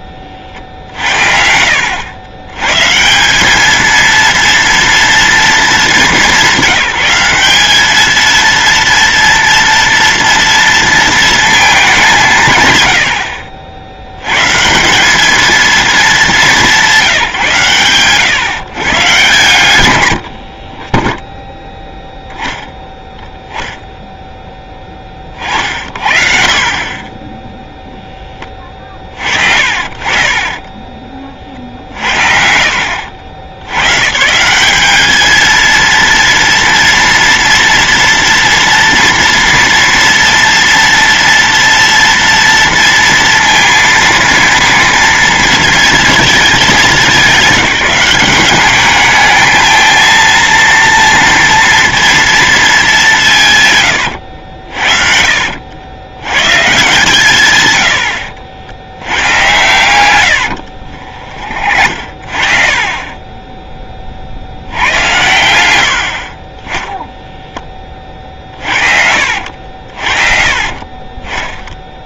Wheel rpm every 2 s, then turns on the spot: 60, 150, 230, 190, 230, 230, 140, 160, 190, 140, 30, 0, 20, 40, 40, 20, 100, 190, 230, 230, 230, 230, 230, 210, 210, 230, 200, 50, 140, 80, 50, 40, 100, 10, 50, 40.
20-22 26-28 30-32 60-64 68-72